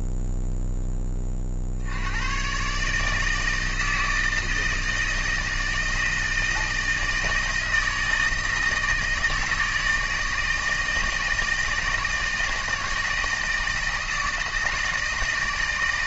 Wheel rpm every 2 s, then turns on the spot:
10, 140, 160, 160, 160, 160, 160, 160.
none